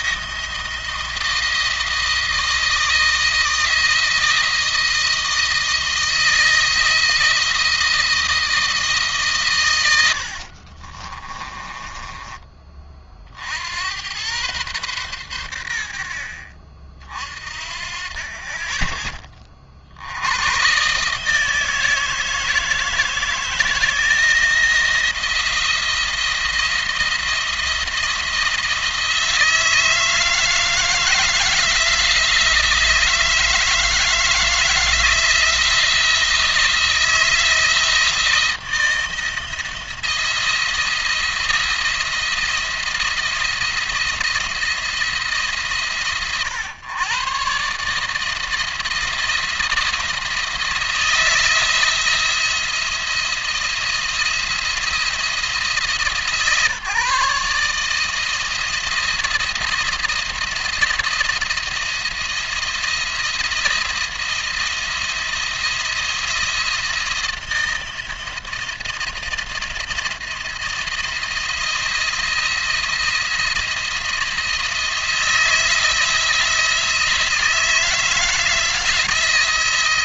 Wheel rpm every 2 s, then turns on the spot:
160, 160, 170, 160, 160, 50, 30, 120, 50, 20, 120, 160, 160, 170, 160, 160, 160, 160, 160, 160, 170, 170, 170, 120, 160, 160, 170, 170, 160, 160, 170, 170, 170, 170, 170, 170, 170, 170, 160, 170.
10-12